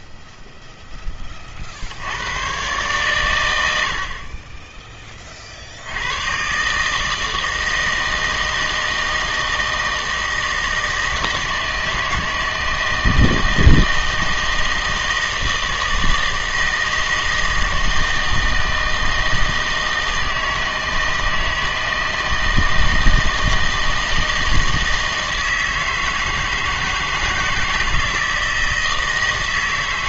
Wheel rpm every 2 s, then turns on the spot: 0, 120, 20, 140, 160, 160, 160, 160, 160, 160, 160, 160, 160, 160, 160.
none